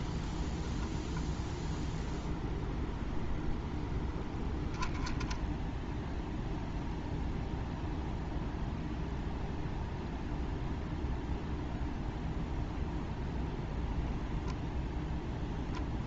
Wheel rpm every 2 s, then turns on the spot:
0, 0, 10, 0, 0, 0, 0, 0.
none